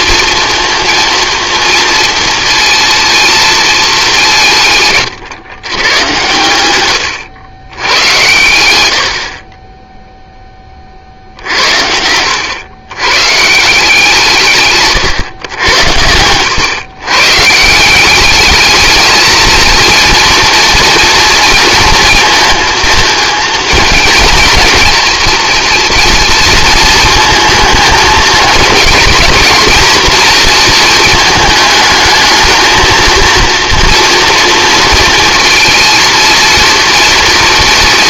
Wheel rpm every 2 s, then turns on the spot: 230, 230, 150, 110, 70, 40, 120, 150, 120, 210, 240, 230, 230, 230, 230, 230, 220, 230, 230.
none